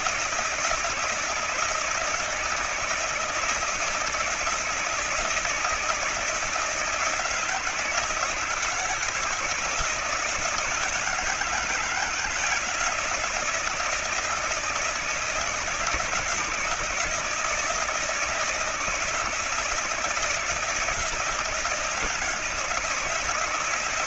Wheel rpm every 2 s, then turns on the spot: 160, 160, 160, 160, 160, 160, 160, 160, 160, 160, 160, 170.
none